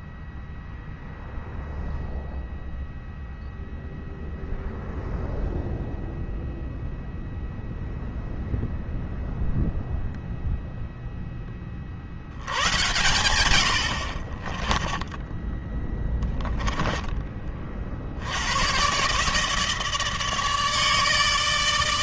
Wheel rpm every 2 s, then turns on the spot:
0, 0, 0, 0, 0, 10, 100, 10, 20, 150, 150.
none